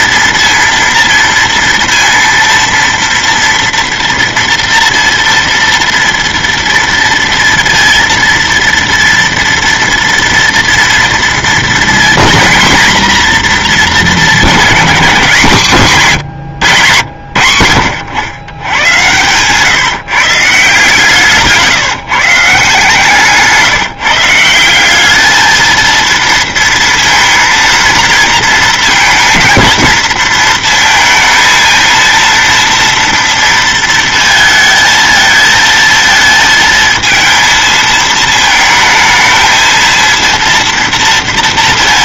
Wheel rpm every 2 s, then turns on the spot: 230, 230, 230, 230, 230, 230, 230, 220, 150, 100, 150, 150, 170, 230, 230, 230, 230, 220, 230, 220, 230.
none